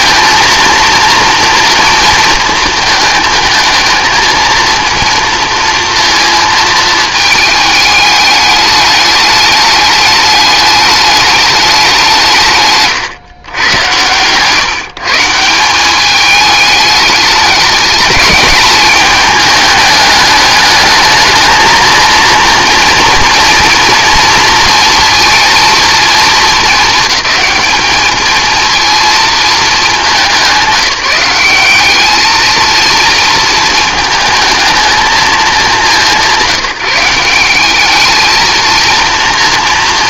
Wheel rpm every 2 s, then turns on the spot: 230, 230, 230, 220, 210, 200, 130, 150, 210, 210, 210, 230, 230, 220, 230, 190, 230, 230, 180, 230.
12-14